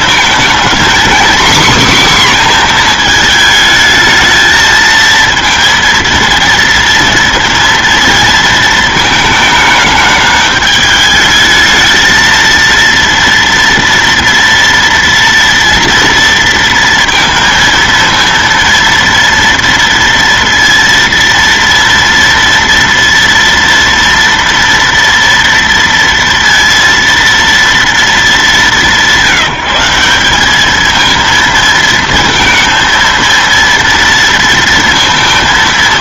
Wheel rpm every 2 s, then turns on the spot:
230, 260, 220, 230, 230, 210, 230, 230, 230, 230, 230, 230, 230, 230, 210, 200, 230, 230.
none